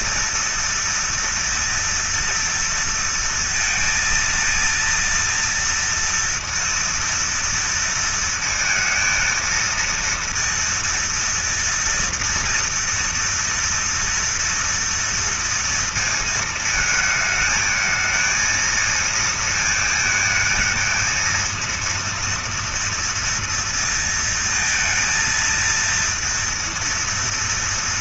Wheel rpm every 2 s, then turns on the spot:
230, 230, 230, 230, 230, 230, 230, 230, 230, 220, 230, 230, 230, 230.
none